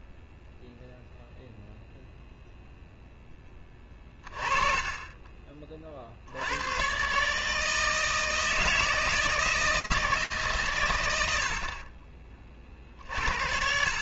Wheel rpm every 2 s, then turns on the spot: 0, 0, 30, 90, 160, 140, 40.
none